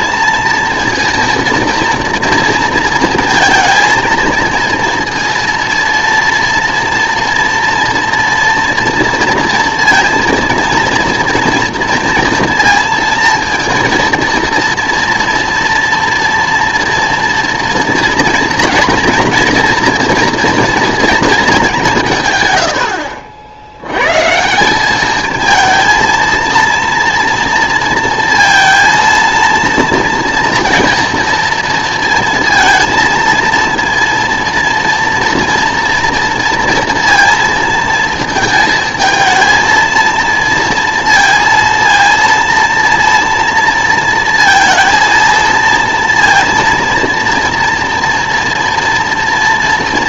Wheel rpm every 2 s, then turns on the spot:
230, 230, 230, 230, 230, 230, 230, 230, 240, 240, 230, 100, 180, 230, 230, 230, 230, 230, 230, 220, 230, 230, 230, 230, 240.
none